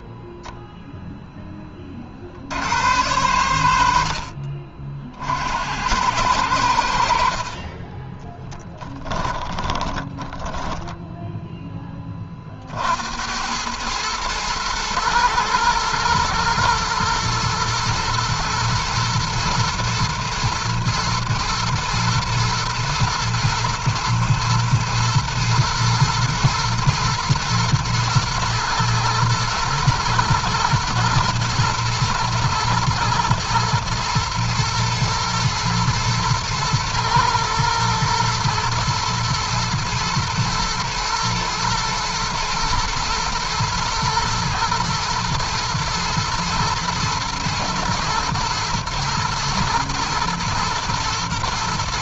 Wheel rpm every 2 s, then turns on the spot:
0, 90, 60, 70, 10, 10, 70, 110, 120, 110, 120, 110, 110, 120, 110, 110, 120, 110, 110, 110, 110, 120, 120, 110, 110, 120.
8-12